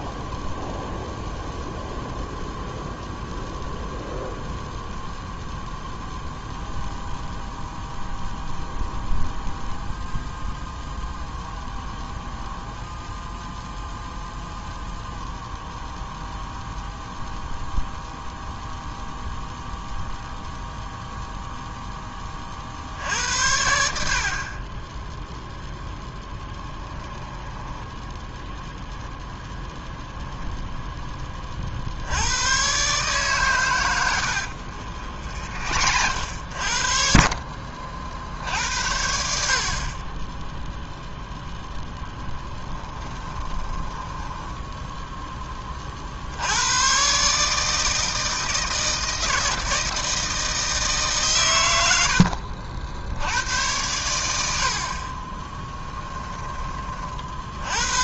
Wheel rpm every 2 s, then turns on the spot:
0, 0, 0, 0, 0, 0, 0, 0, 0, 0, 0, 40, 30, 10, 0, 0, 110, 60, 60, 60, 10, 10, 10, 90, 160, 160, 60, 70, 20.
26-28 34-36 42-46